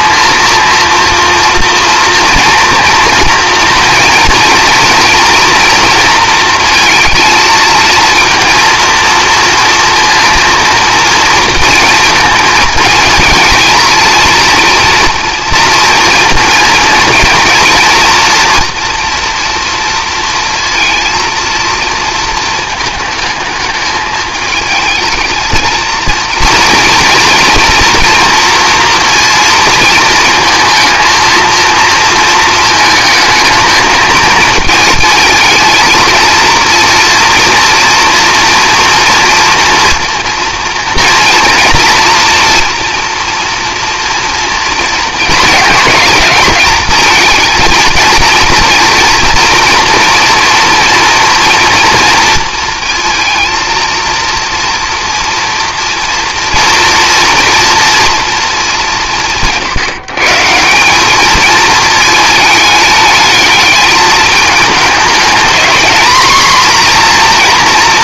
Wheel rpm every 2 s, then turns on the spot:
230, 240, 230, 230, 230, 230, 220, 230, 230, 230, 230, 220, 220, 230, 230, 220, 220, 220, 230, 240, 230, 240, 230, 220, 230, 230, 230, 230, 230, 200, 170, 210, 220, 240.
none